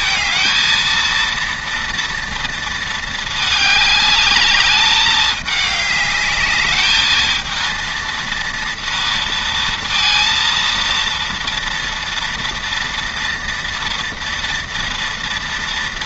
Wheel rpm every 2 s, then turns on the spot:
230, 230, 200, 210, 230, 230, 230, 230.
none